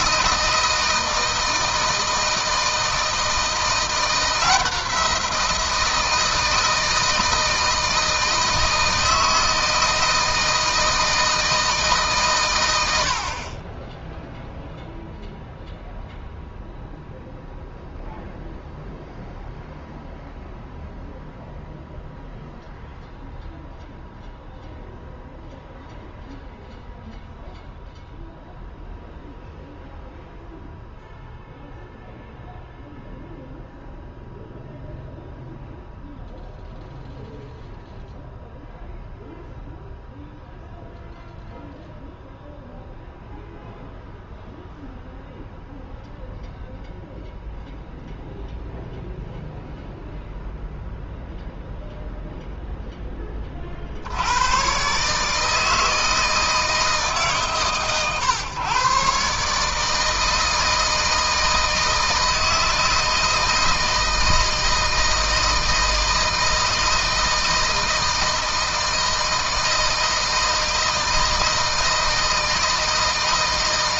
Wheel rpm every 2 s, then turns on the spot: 160, 160, 170, 160, 160, 160, 100, 0, 0, 0, 0, 0, 0, 0, 0, 0, 0, 0, 0, 0, 0, 0, 0, 0, 0, 0, 10, 120, 160, 130, 160, 160, 160, 160, 160, 160, 160.
none